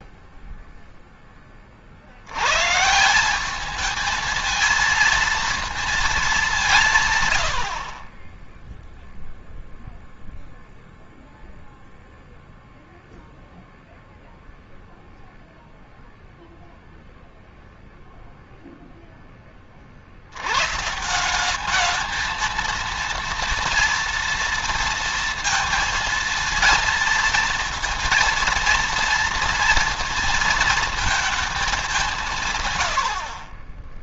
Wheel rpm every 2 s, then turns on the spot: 0, 130, 220, 180, 0, 0, 0, 0, 0, 0, 130, 230, 230, 230, 230, 230, 120.
none